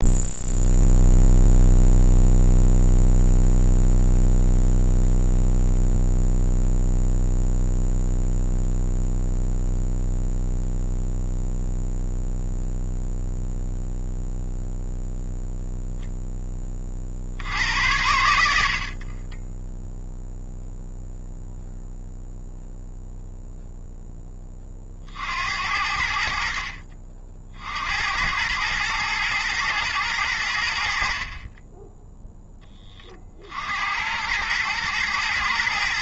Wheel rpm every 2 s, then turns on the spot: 0, 0, 0, 0, 0, 0, 0, 0, 20, 80, 0, 0, 30, 60, 100, 80, 10, 110.
none